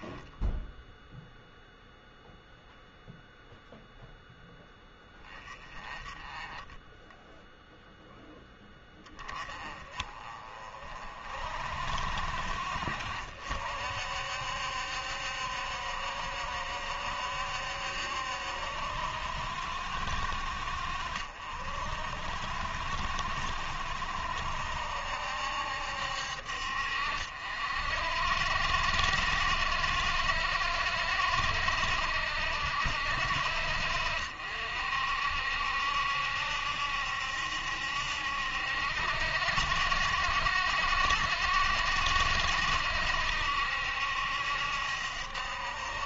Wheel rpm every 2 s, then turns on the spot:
0, 0, 10, 10, 10, 40, 60, 70, 70, 70, 60, 60, 70, 60, 60, 60, 70, 60, 70, 70, 60, 70, 70.
6-8